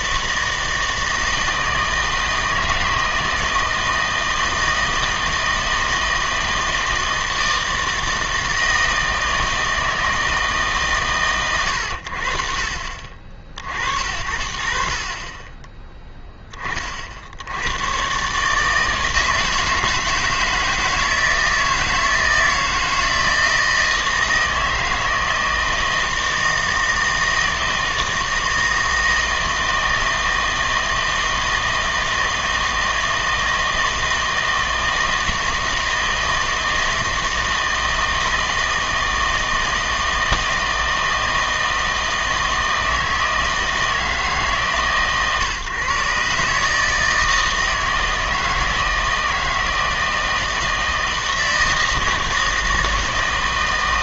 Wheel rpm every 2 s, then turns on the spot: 160, 160, 160, 160, 160, 160, 50, 60, 30, 150, 160, 160, 160, 160, 160, 160, 160, 160, 160, 160, 160, 160, 150, 150, 160, 160, 160.
none